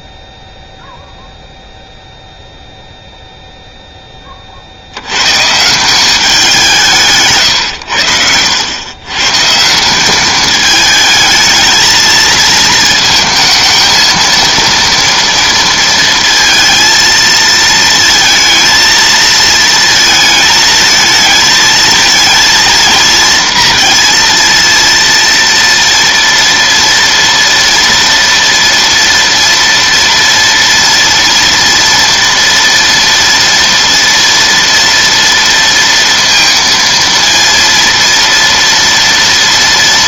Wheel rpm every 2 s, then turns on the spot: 0, 0, 50, 180, 100, 210, 220, 230, 230, 230, 220, 220, 230, 230, 230, 230, 230, 230, 230, 230.
none